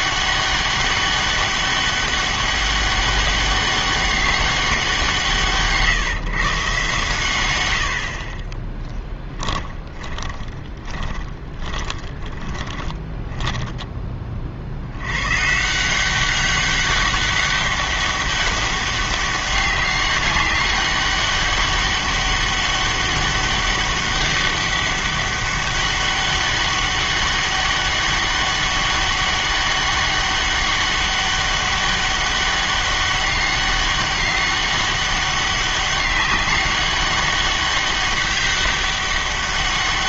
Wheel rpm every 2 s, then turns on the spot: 200, 200, 190, 140, 20, 20, 20, 60, 200, 200, 200, 200, 200, 200, 200, 200, 200, 200, 200, 200.
8-14